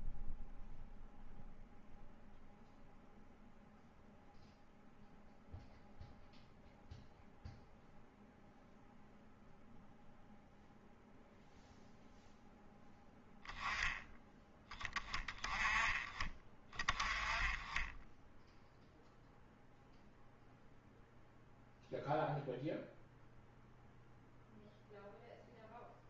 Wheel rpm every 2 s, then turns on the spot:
0, 0, 0, 0, 0, 0, 0, 10, 20, 0, 0, 0, 0.
none